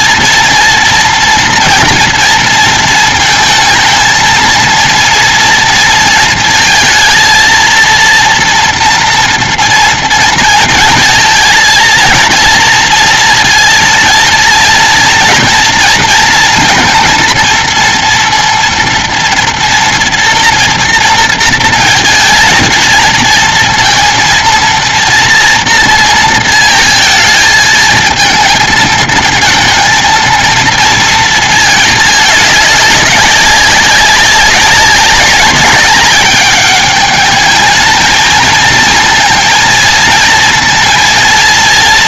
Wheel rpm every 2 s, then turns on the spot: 230, 230, 220, 230, 230, 230, 230, 230, 230, 230, 230, 230, 230, 230, 220, 230, 210, 190, 200, 220, 230.
none